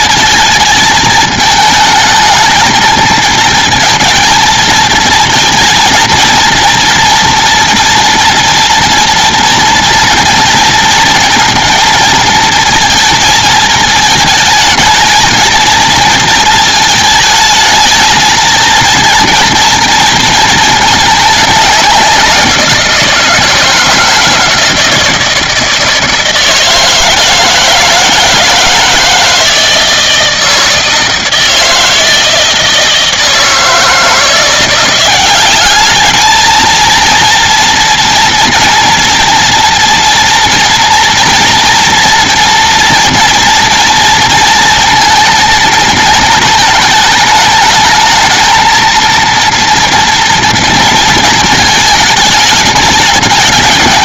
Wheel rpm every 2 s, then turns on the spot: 220, 220, 220, 230, 240, 230, 220, 220, 220, 230, 220, 170, 170, 160, 160, 160, 160, 180, 230, 240, 230, 230, 230, 220, 230, 230, 210.
none